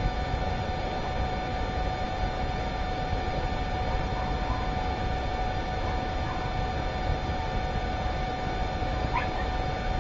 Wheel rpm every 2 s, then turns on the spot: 0, 0, 0, 0, 0.
none